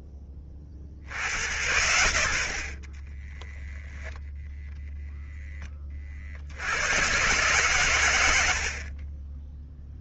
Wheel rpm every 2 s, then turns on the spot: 40, 20, 0, 110, 10.
2-4 8-10